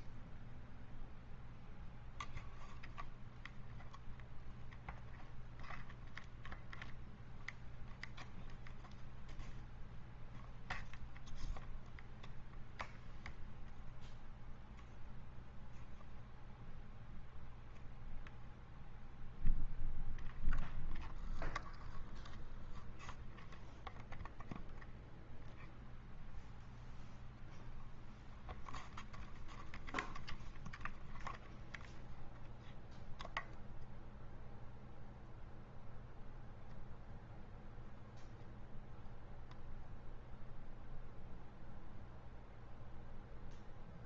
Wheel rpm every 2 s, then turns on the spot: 0, 0, 0, 0, 0, 0, 0, 0, 0, 0, 0, 0, 0, 0, 0, 0, 0, 0, 0, 0, 0, 0.
none